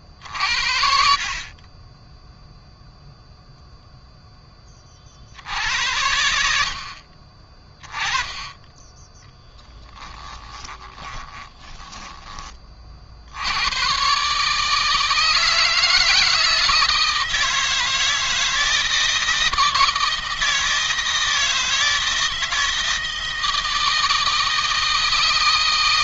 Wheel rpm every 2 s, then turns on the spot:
50, 0, 30, 60, 10, 20, 50, 160, 160, 160, 160, 160, 160.
10-12